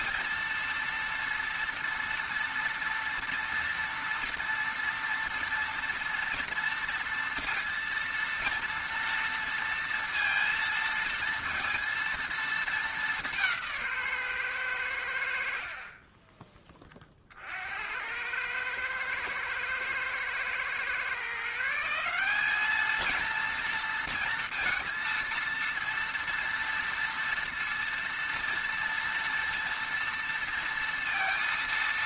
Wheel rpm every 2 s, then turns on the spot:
230, 230, 240, 230, 230, 230, 220, 110, 20, 110, 120, 210, 230, 230, 230, 230.
none